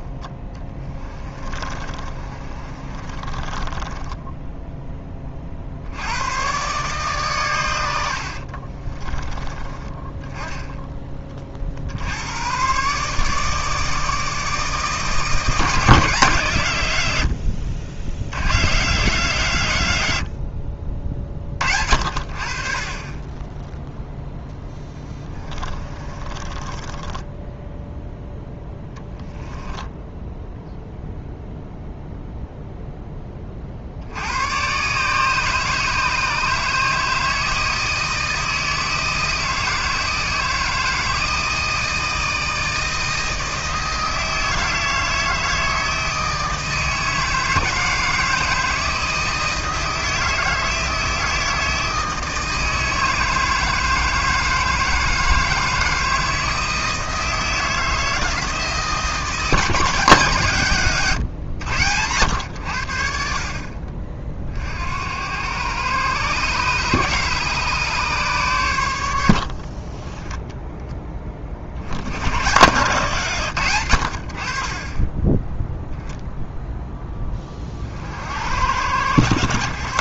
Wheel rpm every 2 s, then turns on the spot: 10, 30, 10, 130, 40, 20, 120, 160, 130, 120, 60, 50, 10, 20, 10, 0, 0, 110, 150, 160, 160, 160, 160, 160, 160, 160, 160, 160, 160, 160, 140, 80, 50, 140, 110, 10, 110, 60, 0, 80.
0-4 8-10 26-30